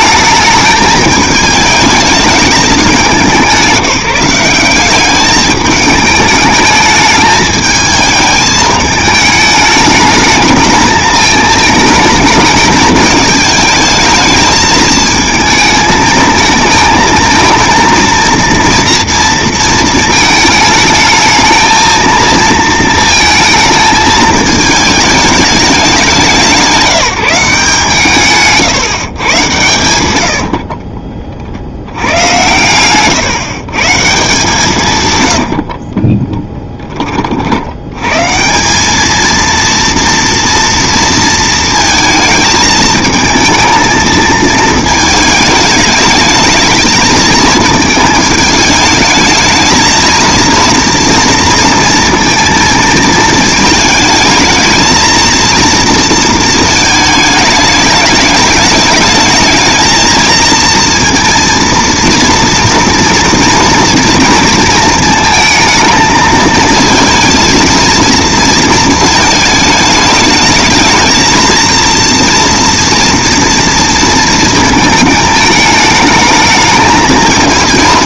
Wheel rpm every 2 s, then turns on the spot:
210, 210, 190, 210, 210, 220, 220, 220, 220, 230, 220, 230, 220, 180, 140, 50, 120, 160, 10, 180, 230, 220, 220, 220, 220, 230, 230, 220, 220, 210, 230, 230, 230, 220, 220, 210, 230, 230, 220.
30-34